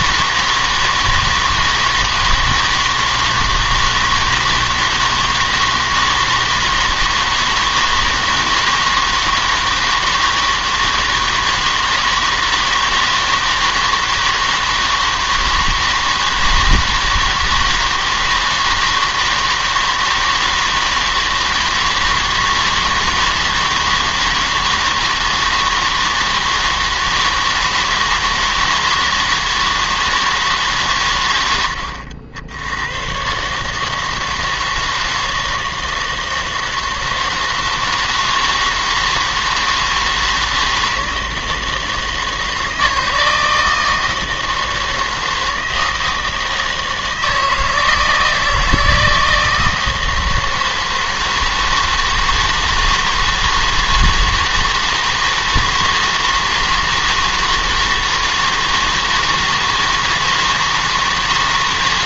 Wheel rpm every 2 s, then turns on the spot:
160, 160, 160, 160, 160, 160, 160, 160, 160, 160, 160, 160, 160, 160, 160, 150, 90, 160, 160, 160, 160, 160, 160, 160, 160, 160, 160, 160, 160, 160, 160.
none